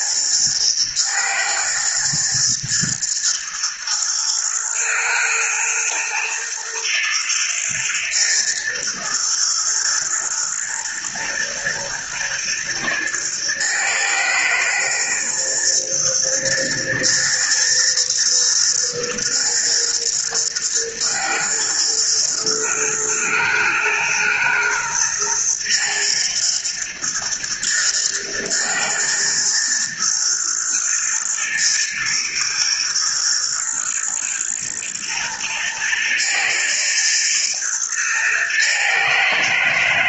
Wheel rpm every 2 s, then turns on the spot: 110, 120, 110, 120, 120, 120, 110, 120, 120, 110, 110, 110, 120, 120, 120, 120, 110, 120, 110, 110.
none